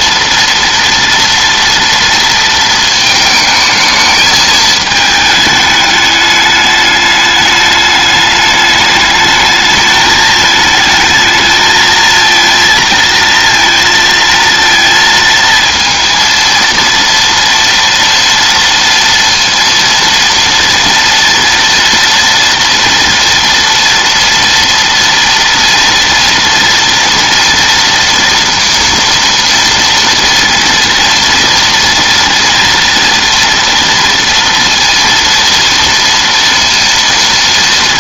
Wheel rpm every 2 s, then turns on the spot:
230, 230, 220, 210, 210, 220, 230, 230, 230, 230, 230, 230, 230, 230, 230, 230, 230, 230, 230.
none